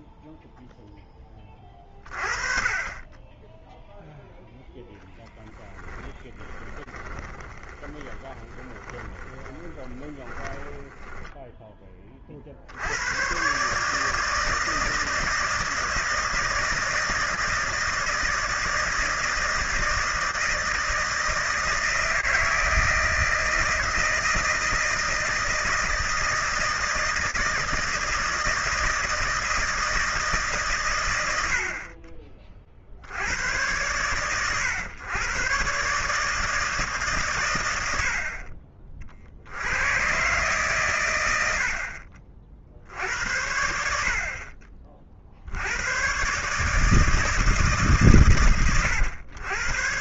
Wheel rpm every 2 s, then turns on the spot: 0, 30, 10, 20, 20, 10, 50, 160, 160, 160, 160, 160, 160, 160, 160, 140, 40, 110, 160, 50, 130, 50, 50, 140, 120.
6-12